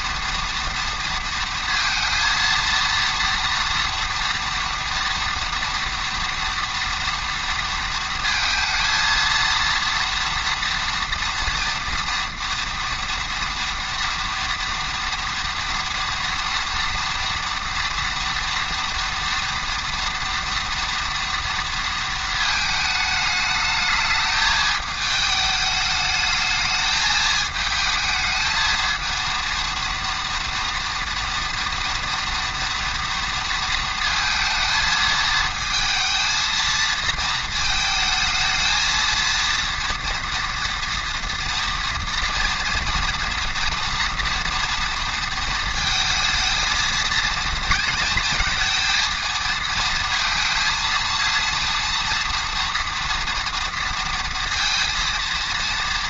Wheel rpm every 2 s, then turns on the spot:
230, 230, 230, 230, 230, 240, 230, 230, 230, 230, 230, 220, 210, 210, 220, 230, 230, 230, 230, 220, 230, 230, 230, 220, 230, 230, 230, 230.
none